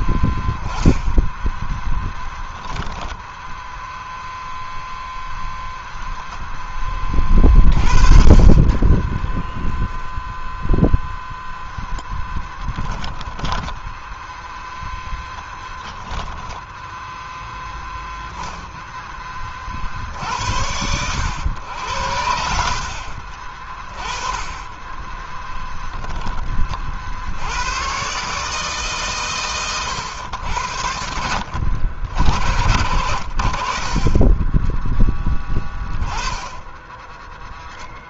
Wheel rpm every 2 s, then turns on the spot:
0, 10, 0, 10, 30, 0, 10, 0, 10, 0, 80, 70, 20, 20, 140, 90, 80, 20, 10.
12-14 16-18 24-26